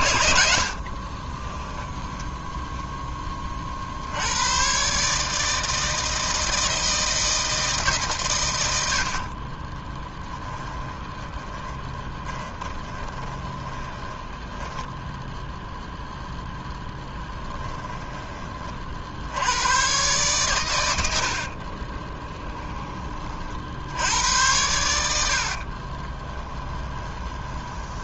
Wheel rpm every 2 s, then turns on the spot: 60, 0, 120, 160, 90, 10, 20, 10, 0, 40, 110, 20, 80, 10.
0-2 10-16 26-28